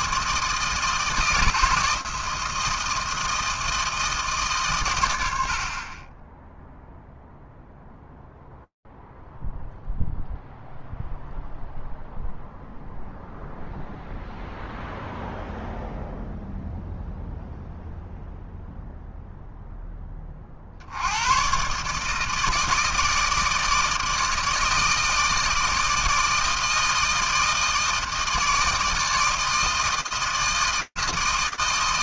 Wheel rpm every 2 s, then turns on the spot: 160, 160, 140, 0, 0, 0, 0, 0, 0, 0, 40, 160, 160, 160, 160, 160.
none